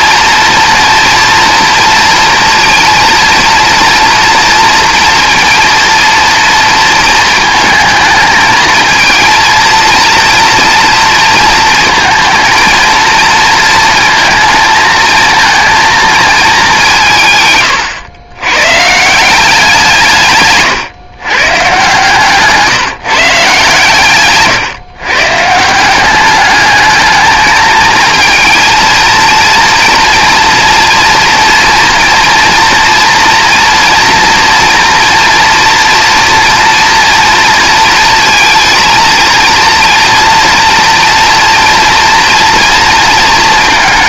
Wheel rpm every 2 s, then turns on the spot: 230, 230, 230, 220, 220, 230, 230, 220, 190, 130, 140, 150, 130, 210, 230, 230, 230, 230, 230, 230, 230, 230.
none